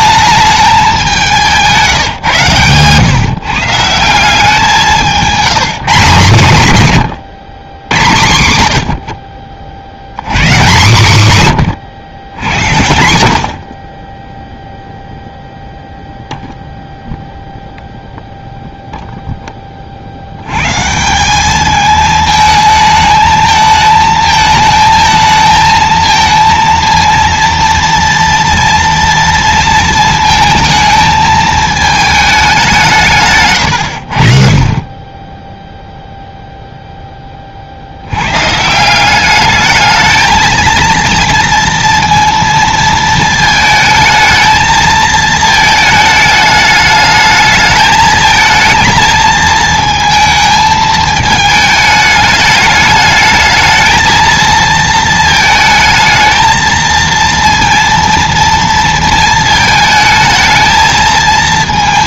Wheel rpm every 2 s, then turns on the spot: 200, 120, 180, 130, 70, 160, 70, 0, 0, 0, 150, 220, 220, 230, 230, 220, 180, 20, 0, 160, 230, 230, 220, 210, 220, 220, 210, 230, 230, 230, 220.
none